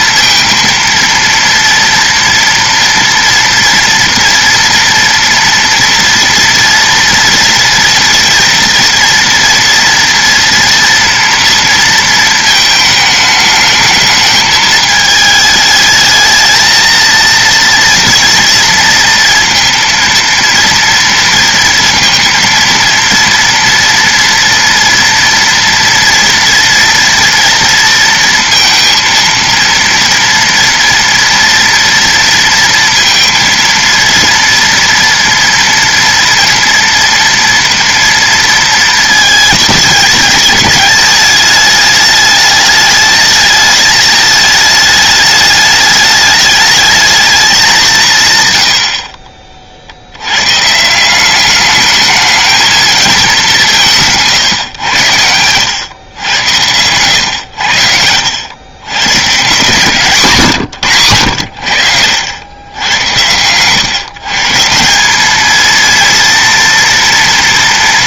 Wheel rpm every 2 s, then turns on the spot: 230, 230, 230, 230, 230, 230, 220, 220, 220, 230, 230, 230, 230, 230, 230, 240, 230, 230, 230, 230, 210, 210, 220, 220, 80, 140, 220, 130, 110, 110, 140, 100, 160, 230.
none